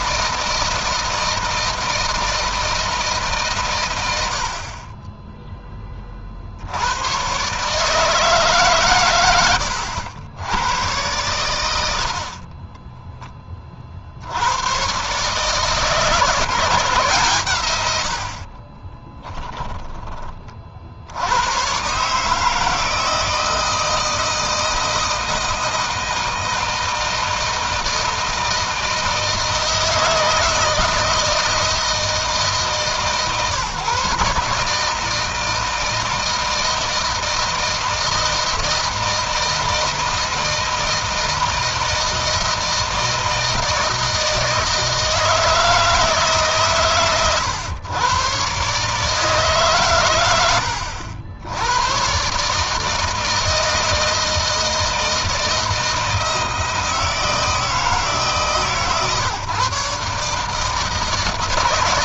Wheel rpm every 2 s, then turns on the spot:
160, 150, 30, 90, 120, 110, 10, 130, 150, 30, 60, 160, 160, 160, 160, 160, 150, 160, 160, 160, 160, 160, 160, 130, 140, 70, 150, 160, 160, 130, 160.
18-20